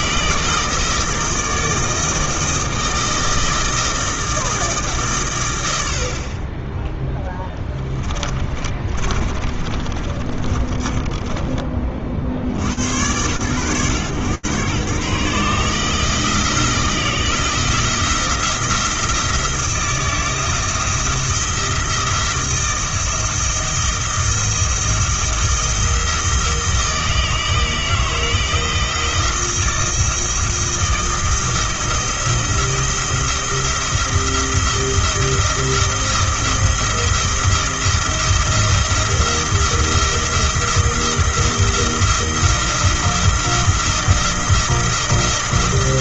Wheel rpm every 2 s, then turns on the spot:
160, 160, 160, 20, 30, 40, 80, 130, 160, 170, 160, 170, 170, 160, 160, 160, 170, 170, 170, 170, 170, 170, 170.
8-12